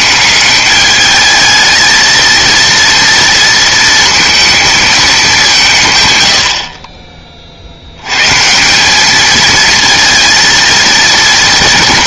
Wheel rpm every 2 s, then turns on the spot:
200, 230, 220, 60, 160, 230.
none